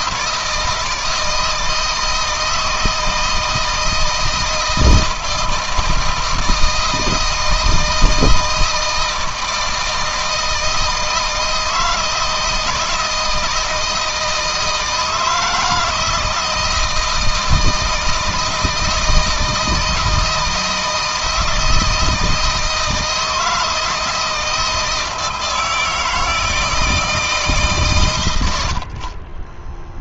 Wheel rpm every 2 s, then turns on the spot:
160, 160, 160, 160, 160, 160, 160, 160, 160, 160, 160, 160, 160, 160, 50.
none